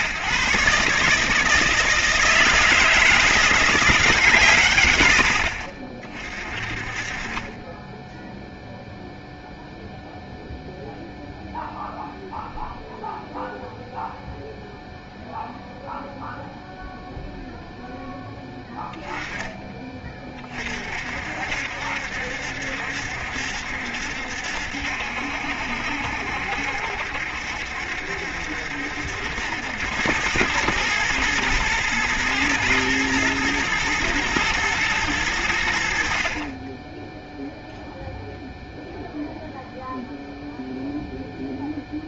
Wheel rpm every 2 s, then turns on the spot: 150, 170, 100, 40, 0, 0, 0, 0, 0, 10, 30, 70, 70, 70, 70, 100, 120, 110, 20, 0, 0.
none